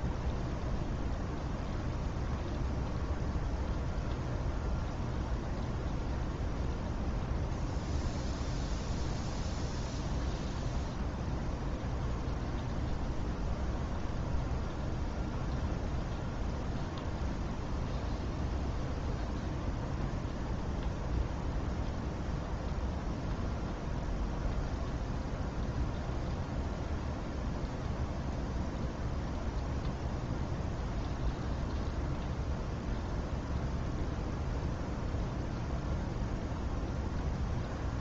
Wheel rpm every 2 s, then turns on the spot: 0, 0, 0, 0, 0, 0, 0, 0, 0, 0, 0, 0, 0, 0, 0, 0, 0, 0, 0.
none